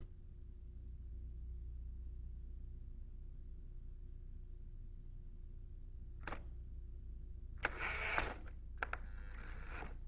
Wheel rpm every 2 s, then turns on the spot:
0, 0, 0, 10, 10.
8-10